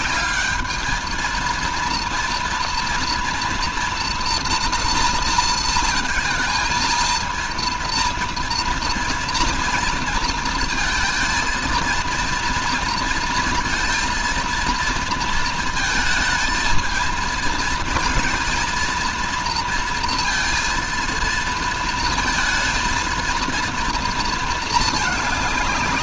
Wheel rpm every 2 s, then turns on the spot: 220, 230, 230, 230, 240, 230, 230, 230, 230, 230, 230, 230, 220.
none